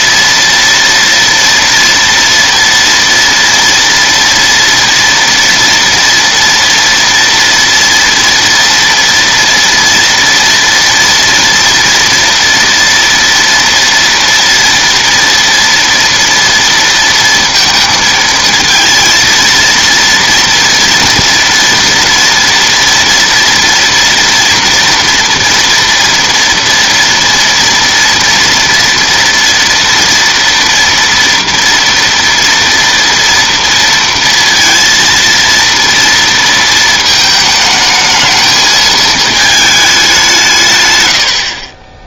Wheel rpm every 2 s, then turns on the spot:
230, 230, 230, 230, 230, 230, 230, 230, 230, 230, 230, 230, 230, 230, 230, 230, 230, 230, 230, 220, 130.
none